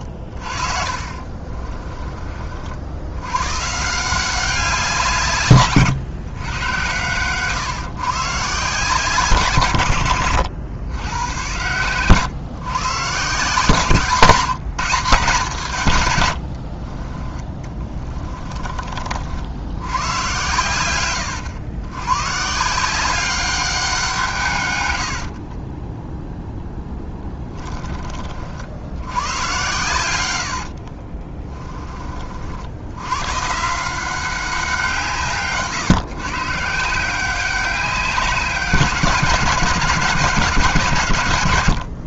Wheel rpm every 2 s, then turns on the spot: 40, 70, 180, 110, 150, 100, 140, 180, 60, 30, 110, 150, 130, 10, 80, 60, 80, 180, 150, 190, 160.
0-2 16-18 30-32